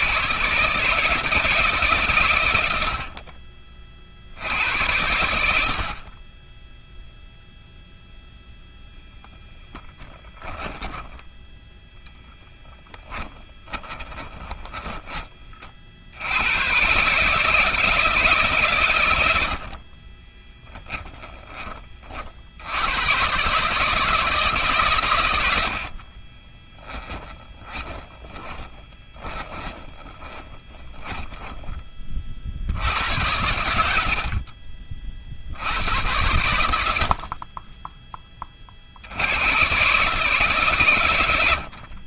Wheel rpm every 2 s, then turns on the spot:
160, 50, 80, 0, 10, 10, 10, 20, 140, 100, 10, 100, 120, 20, 20, 20, 90, 50, 70, 70, 120.
12-14 20-22 26-32